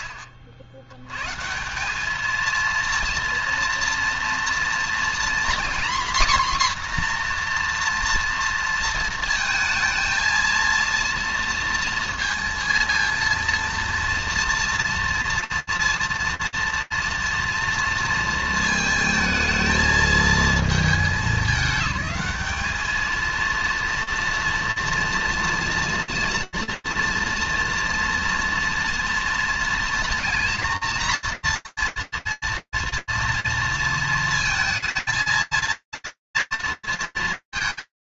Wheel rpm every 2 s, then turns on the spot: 130, 230, 240, 250, 220, 230, 230, 230, 230, 220, 210, 230, 230, 230, 230, 230, 240, 220, 230.
none